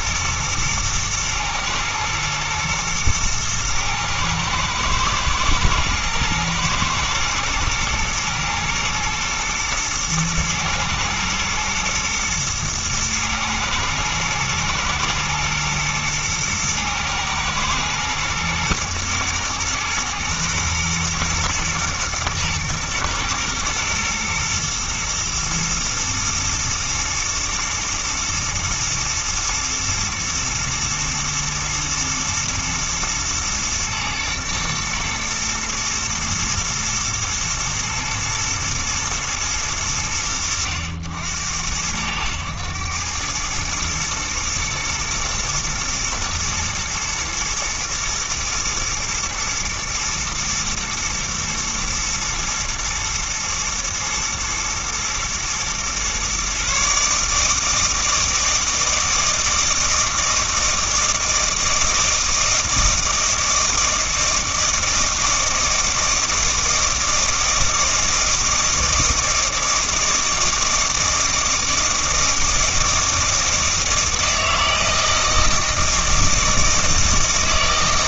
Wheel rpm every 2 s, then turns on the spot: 110, 110, 110, 110, 120, 120, 110, 110, 110, 110, 120, 120, 110, 110, 110, 110, 120, 120, 120, 110, 80, 100, 110, 120, 110, 120, 120, 120, 140, 160, 160, 160, 160, 160, 160, 160, 160, 160, 160.
none